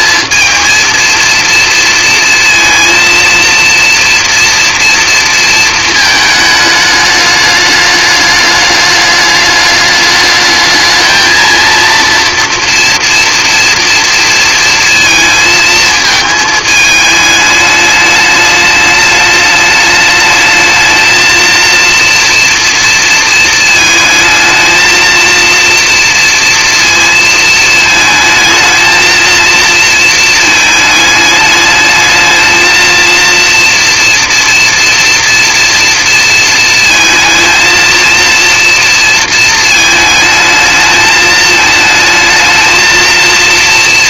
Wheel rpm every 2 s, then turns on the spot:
230, 230, 230, 210, 210, 220, 240, 230, 210, 210, 220, 230, 220, 230, 230, 210, 230, 230, 230, 230, 220, 220.
none